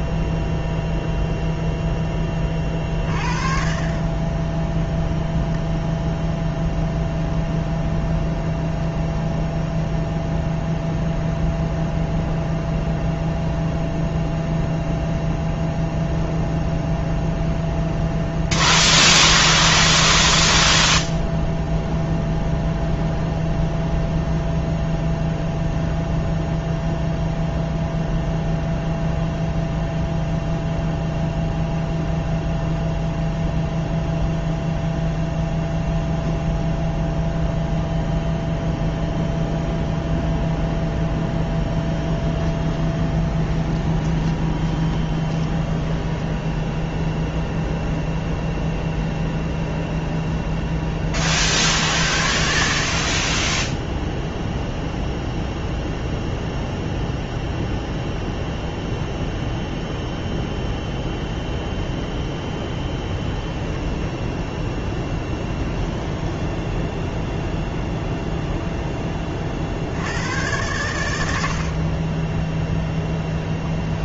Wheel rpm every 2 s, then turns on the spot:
0, 20, 10, 0, 0, 0, 0, 0, 0, 0, 0, 0, 0, 0, 0, 0, 0, 0, 0, 0, 0, 10, 20, 10, 0, 0, 70, 0, 0, 0, 0, 0, 0, 10, 0, 110, 10.
42-48 66-68